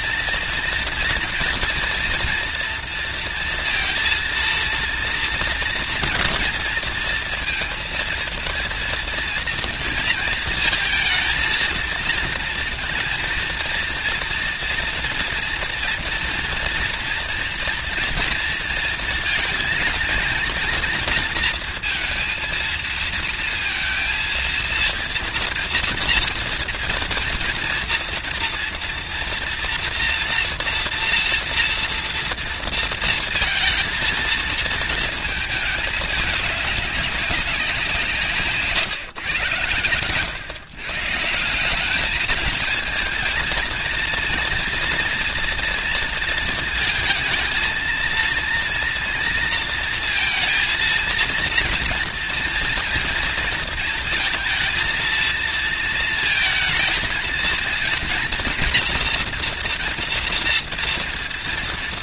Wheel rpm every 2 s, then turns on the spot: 230, 230, 230, 240, 230, 230, 230, 240, 240, 230, 230, 230, 230, 230, 230, 230, 230, 230, 200, 150, 130, 220, 230, 230, 230, 230, 230, 230, 230, 230, 230.
38-40